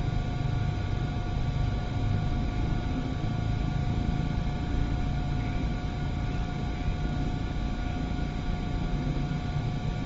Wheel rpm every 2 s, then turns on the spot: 0, 0, 0, 0, 0.
none